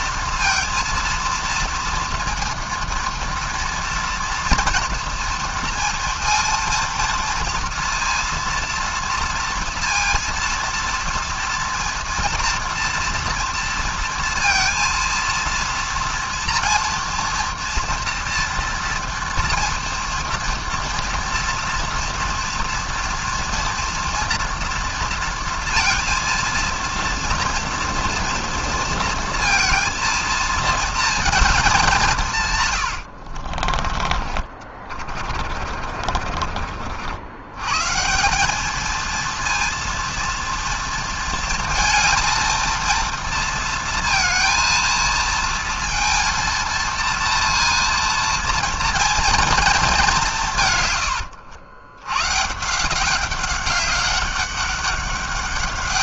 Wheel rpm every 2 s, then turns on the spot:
230, 230, 230, 230, 230, 230, 230, 230, 240, 230, 230, 230, 230, 230, 230, 220, 140, 40, 50, 200, 230, 230, 230, 230, 230, 150, 150, 200.
34-38